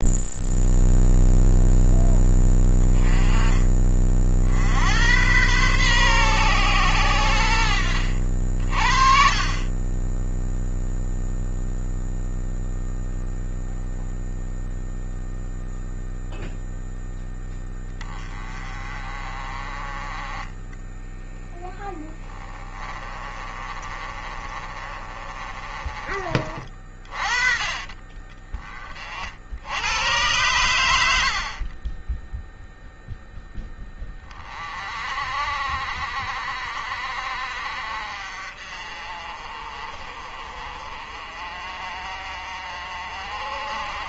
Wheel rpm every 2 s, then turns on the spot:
0, 10, 60, 120, 50, 0, 0, 0, 0, 20, 20, 20, 30, 30, 40, 90, 0, 30, 50, 50, 50, 50.
20-26